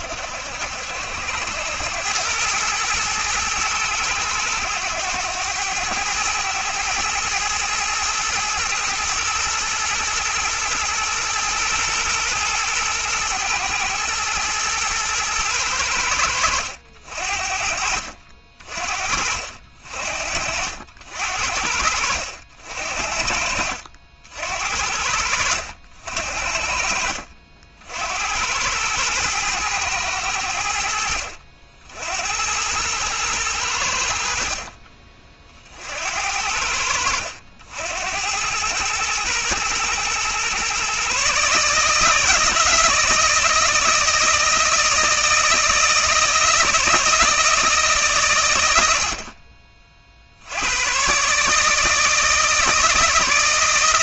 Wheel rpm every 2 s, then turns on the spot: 80, 110, 100, 110, 110, 110, 110, 120, 70, 50, 60, 60, 60, 50, 110, 70, 110, 30, 80, 110, 140, 160, 160, 160, 70, 130, 160.
none